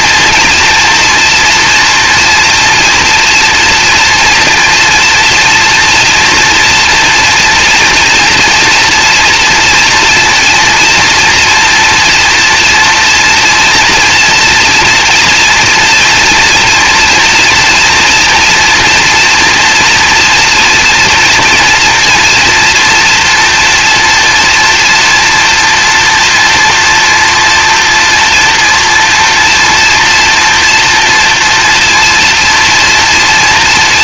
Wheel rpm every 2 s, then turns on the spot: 230, 230, 230, 240, 240, 230, 240, 240, 230, 240, 230, 230, 240, 230, 240, 240, 230.
none